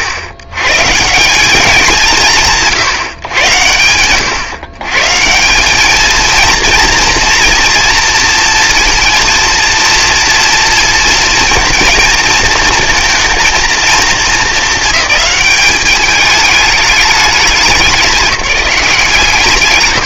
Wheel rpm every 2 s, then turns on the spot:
130, 160, 130, 230, 230, 230, 230, 210, 210, 180.
none